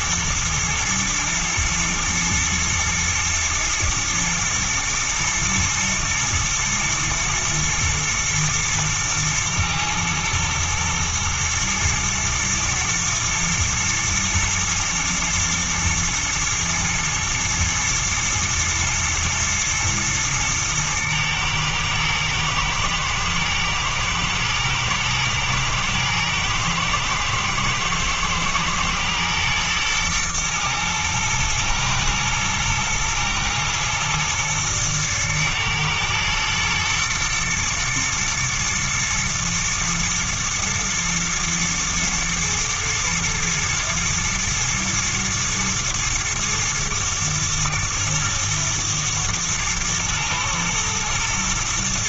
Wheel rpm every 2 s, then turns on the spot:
110, 110, 110, 120, 110, 110, 120, 110, 110, 110, 120, 120, 110, 120, 120, 120, 120, 110, 110, 120, 110, 120, 110, 110, 110, 110.
none